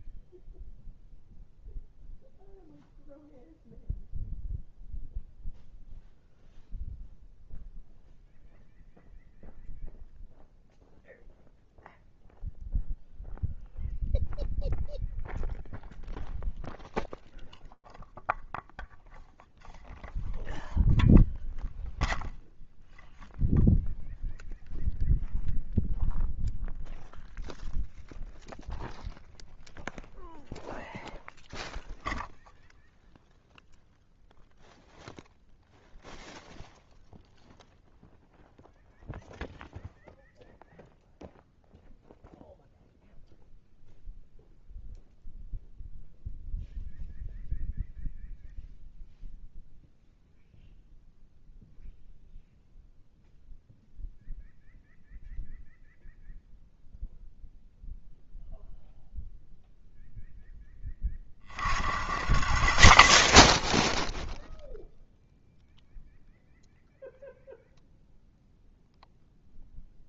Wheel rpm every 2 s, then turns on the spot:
0, 0, 0, 0, 0, 0, 0, 0, 0, 0, 0, 0, 0, 0, 0, 0, 0, 0, 0, 0, 0, 0, 0, 0, 0, 0, 0, 0, 0, 0, 10, 60, 0, 0, 0.
none